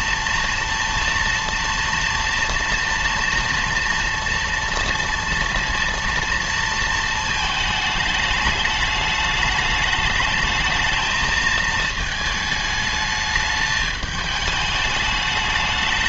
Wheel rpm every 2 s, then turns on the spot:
230, 230, 230, 230, 210, 220, 210, 210.
none